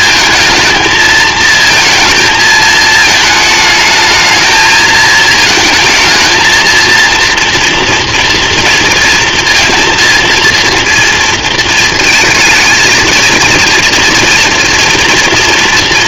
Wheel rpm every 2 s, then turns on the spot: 230, 220, 220, 230, 230, 230, 220, 230.
none